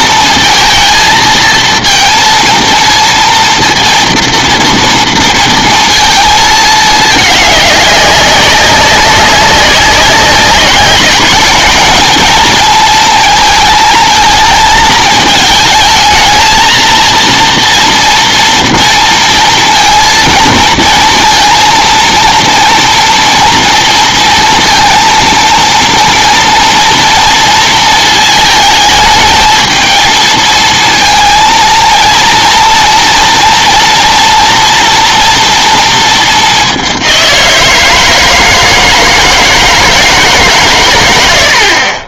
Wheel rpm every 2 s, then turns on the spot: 230, 230, 230, 220, 200, 190, 220, 220, 230, 230, 230, 230, 230, 230, 220, 230, 230, 240, 200, 160, 120.
none